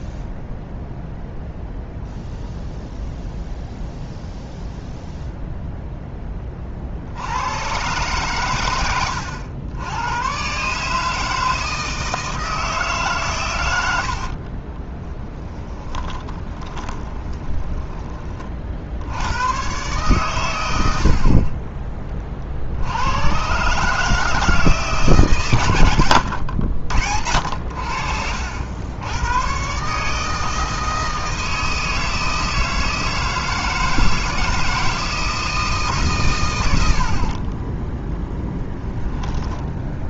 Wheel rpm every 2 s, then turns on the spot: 0, 0, 0, 50, 110, 130, 150, 20, 30, 60, 80, 60, 160, 80, 80, 160, 160, 160, 80, 10.
14-18 38-40